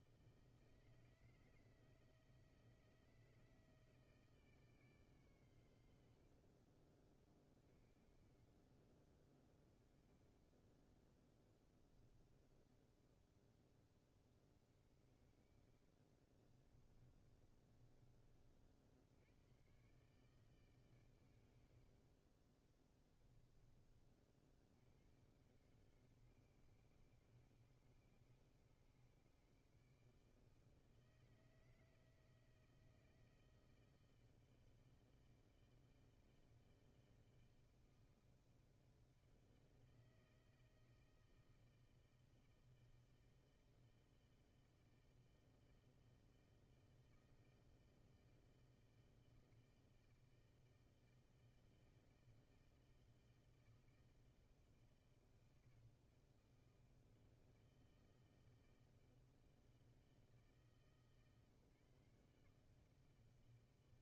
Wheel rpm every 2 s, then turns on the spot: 160, 160, 150, 40, 30, 20, 20, 30, 30, 50, 150, 30, 60, 110, 120, 150, 160, 160, 160, 160, 160, 160, 160, 160, 160, 160, 160, 160, 160, 160, 160, 150.
12-14 16-18 22-24